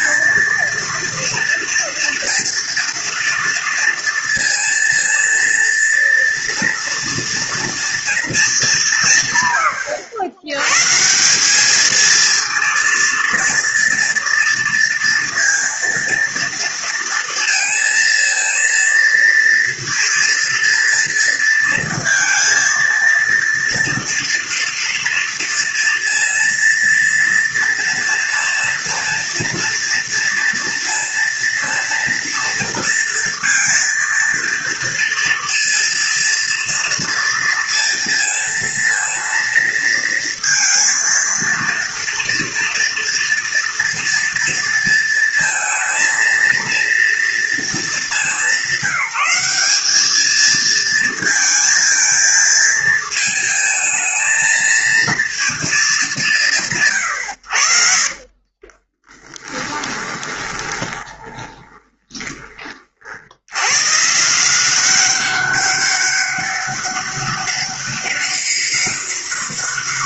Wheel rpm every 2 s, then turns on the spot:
230, 230, 230, 230, 190, 120, 230, 230, 230, 230, 230, 230, 230, 230, 230, 230, 230, 230, 230, 230, 230, 230, 230, 230, 200, 220, 220, 230, 160, 30, 20, 40, 180, 200, 200.
58-62